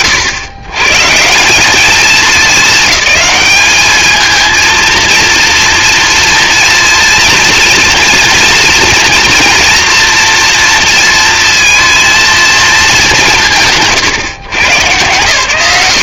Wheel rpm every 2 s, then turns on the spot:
130, 200, 230, 230, 230, 230, 210, 110.
none